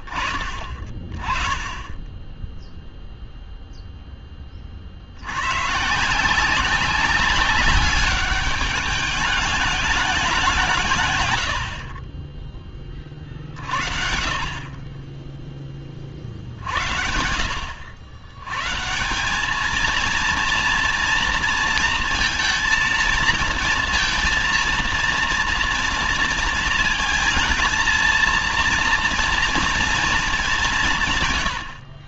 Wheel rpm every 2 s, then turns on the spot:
20, 0, 60, 190, 210, 150, 40, 30, 70, 190, 230, 230, 230, 220, 230, 130.
none